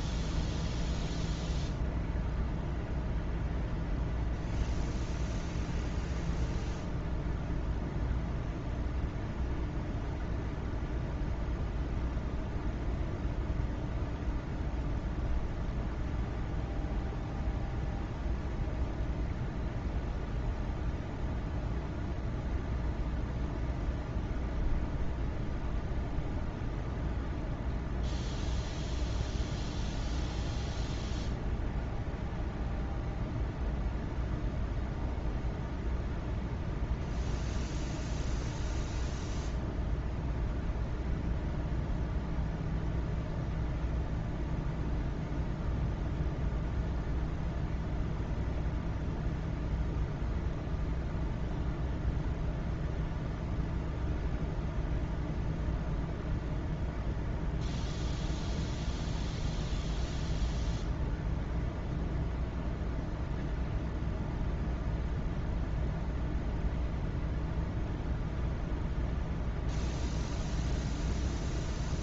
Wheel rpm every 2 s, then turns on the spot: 0, 0, 0, 0, 0, 0, 0, 0, 0, 0, 0, 0, 0, 0, 0, 0, 0, 0, 0, 0, 0, 0, 0, 0, 0, 0, 0, 0, 0, 0, 0, 0, 0, 0, 0, 0.
none